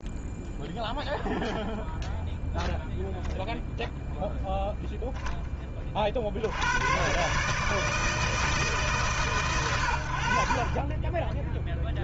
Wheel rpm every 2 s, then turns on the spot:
0, 0, 0, 140, 140, 10.
10-12